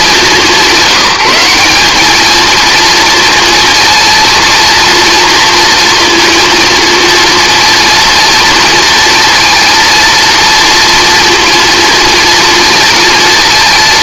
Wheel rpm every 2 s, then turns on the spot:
190, 230, 230, 230, 230, 230, 230.
none